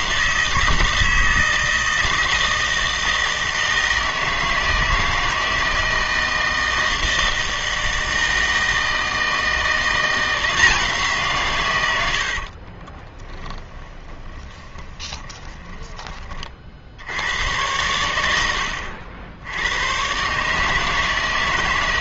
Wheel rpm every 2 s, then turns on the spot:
160, 160, 160, 160, 160, 170, 40, 20, 40, 90, 150.
12-16